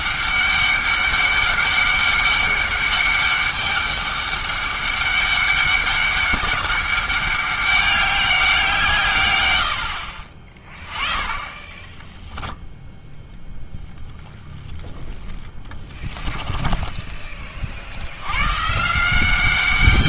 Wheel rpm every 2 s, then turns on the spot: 200, 200, 200, 200, 170, 20, 10, 10, 20, 130.
10-12